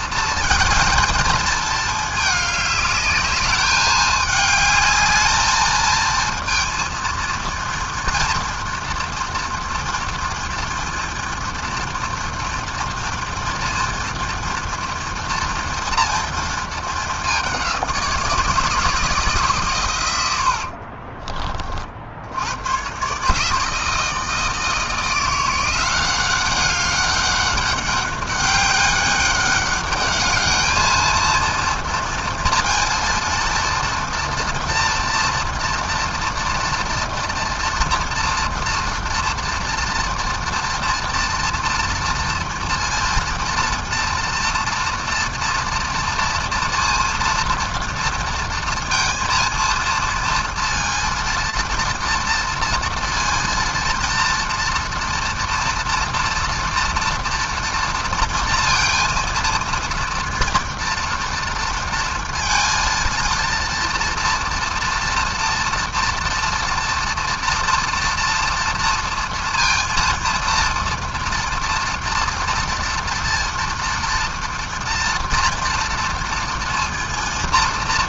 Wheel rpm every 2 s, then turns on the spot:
220, 210, 210, 230, 230, 240, 230, 230, 220, 160, 70, 90, 160, 190, 200, 220, 230, 230, 230, 240, 230, 230, 230, 230, 230, 230, 230, 230, 230, 230, 240, 230, 230, 230, 230, 230, 230, 240, 230.
20-22